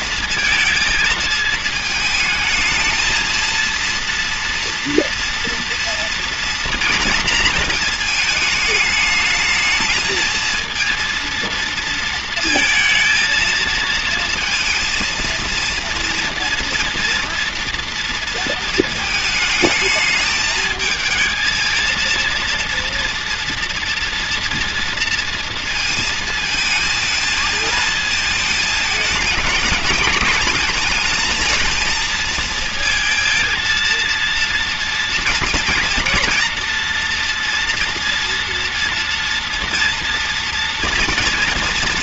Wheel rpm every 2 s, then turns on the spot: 220, 220, 230, 230, 220, 230, 220, 230, 230, 230, 220, 230, 230, 220, 220, 220, 220, 230, 230, 230, 230.
none